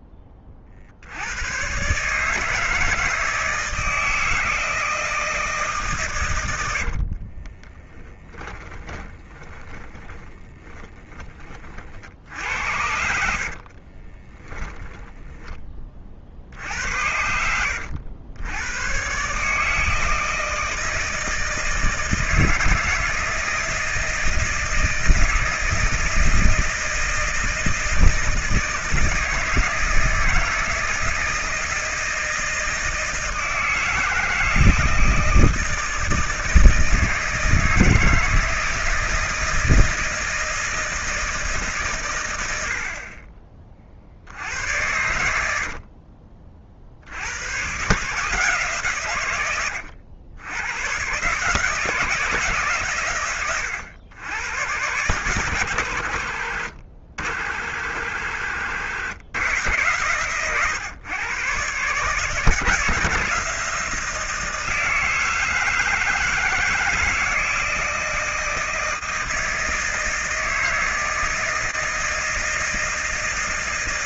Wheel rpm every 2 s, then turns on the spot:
30, 160, 160, 70, 20, 20, 70, 10, 80, 110, 160, 160, 160, 160, 160, 160, 160, 160, 160, 160, 160, 60, 90, 60, 140, 120, 140, 110, 60, 70, 120, 160, 170, 160, 160, 160, 160.
6-16